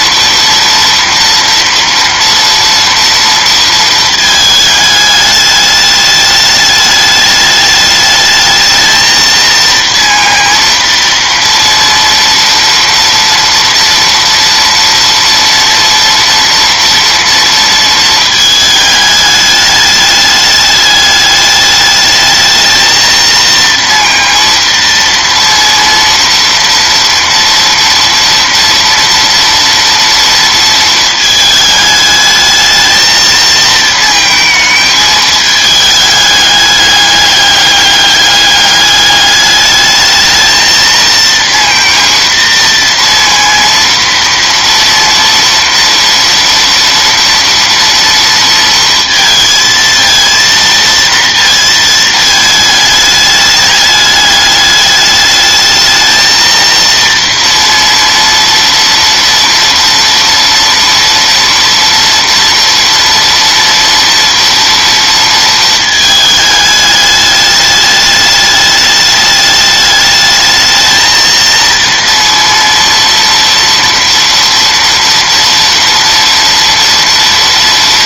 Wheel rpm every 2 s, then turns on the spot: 230, 230, 220, 210, 220, 230, 230, 230, 230, 220, 210, 220, 230, 230, 230, 230, 220, 220, 210, 200, 220, 230, 230, 230, 230, 230, 220, 210, 230, 230, 230, 230, 230, 210, 210, 220, 230, 230, 230.
none